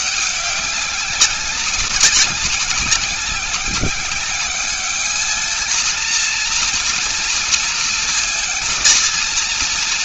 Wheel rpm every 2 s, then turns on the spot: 200, 190, 210, 230, 220.
none